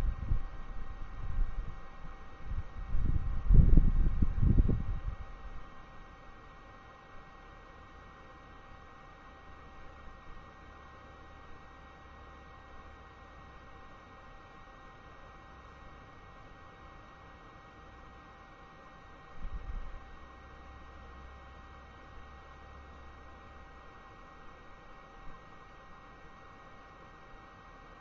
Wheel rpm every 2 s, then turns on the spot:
0, 0, 0, 0, 0, 0, 0, 0, 0, 0, 0, 0, 0, 0.
none